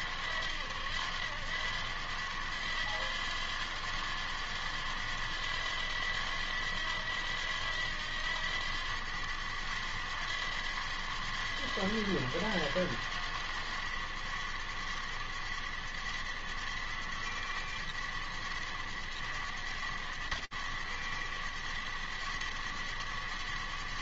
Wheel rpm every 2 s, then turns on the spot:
90, 100, 90, 90, 100, 90, 100, 100, 100, 100, 100, 100.
none